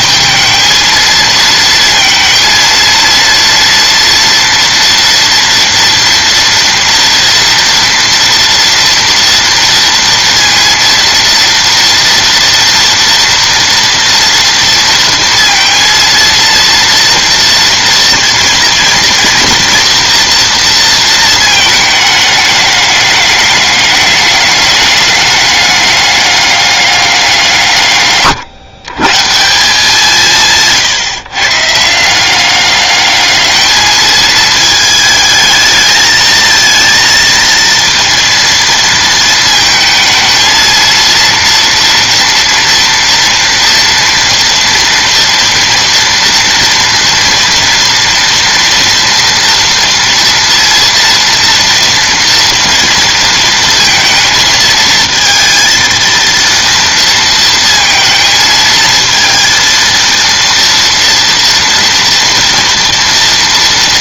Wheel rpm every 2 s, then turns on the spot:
220, 230, 230, 230, 230, 230, 230, 230, 230, 230, 230, 210, 210, 200, 130, 150, 200, 220, 220, 230, 230, 230, 230, 230, 230, 230, 230, 220, 230, 220, 230, 230.
30-32